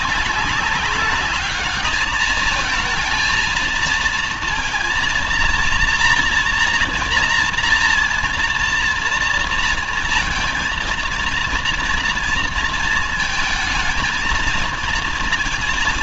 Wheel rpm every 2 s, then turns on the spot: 200, 220, 230, 230, 230, 230, 230, 230.
none